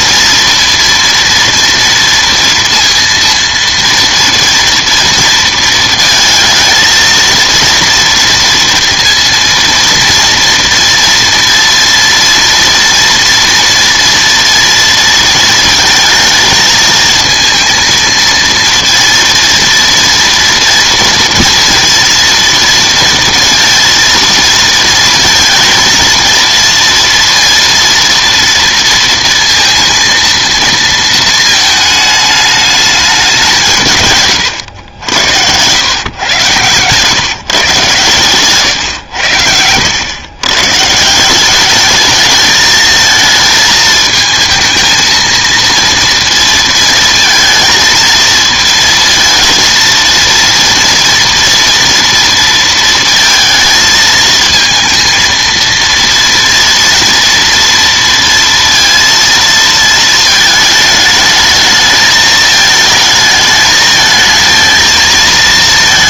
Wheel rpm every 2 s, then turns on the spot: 230, 230, 230, 220, 230, 230, 230, 230, 220, 230, 240, 230, 230, 230, 230, 230, 210, 100, 110, 120, 140, 220, 230, 230, 230, 230, 230, 230, 240, 230, 220, 220, 220.
36-40